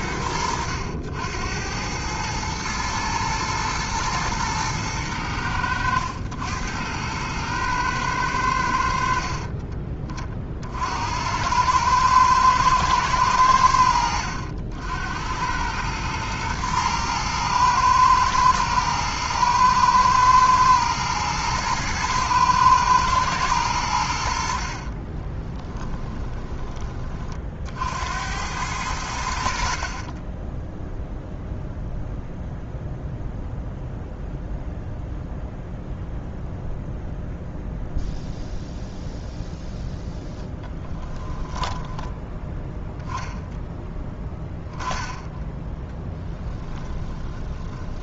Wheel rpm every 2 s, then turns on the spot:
80, 110, 100, 100, 60, 70, 110, 80, 110, 110, 110, 110, 40, 30, 90, 0, 0, 0, 0, 0, 10, 0, 20, 20.
24-26 40-42 46-48